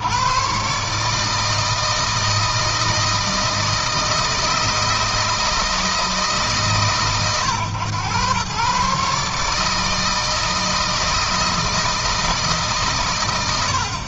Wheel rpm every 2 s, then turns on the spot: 140, 160, 160, 130, 130, 160, 130.
none